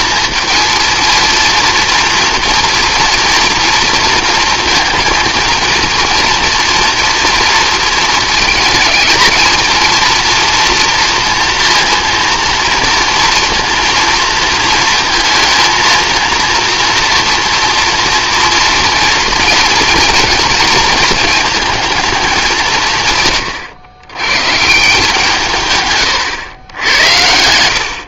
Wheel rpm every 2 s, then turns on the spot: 230, 230, 230, 230, 220, 230, 230, 230, 230, 230, 230, 170, 140, 100.
none